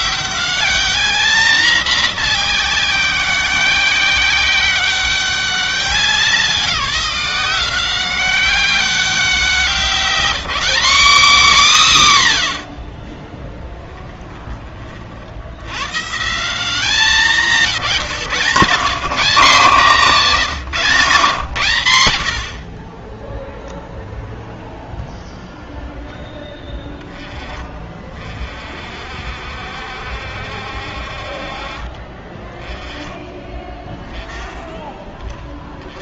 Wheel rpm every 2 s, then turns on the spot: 200, 190, 190, 190, 190, 180, 30, 10, 160, 130, 180, 70, 0, 10, 40, 70, 20, 10.
none